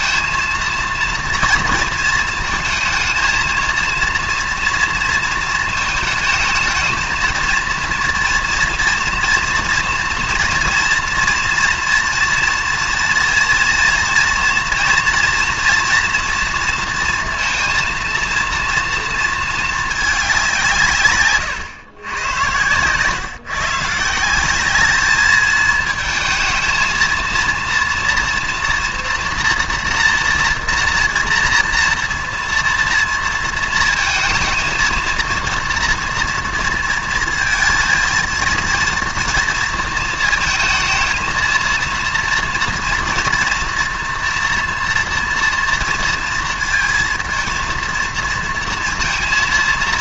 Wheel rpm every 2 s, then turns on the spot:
230, 220, 230, 220, 230, 240, 230, 230, 230, 230, 170, 120, 210, 220, 230, 230, 230, 230, 230, 220, 220, 240, 230, 230, 230.
none